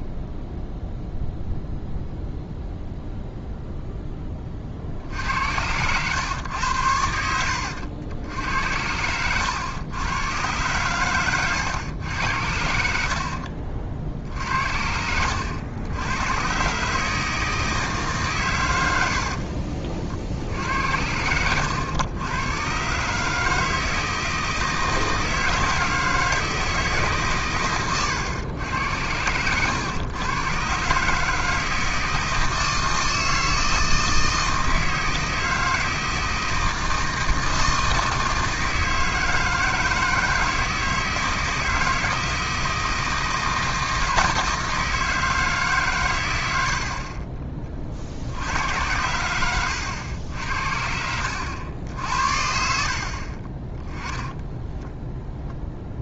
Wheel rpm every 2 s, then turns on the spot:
0, 0, 40, 100, 80, 110, 80, 70, 120, 110, 70, 120, 160, 160, 100, 130, 160, 160, 160, 160, 160, 160, 160, 80, 80, 70, 60, 10.
46-48 54-56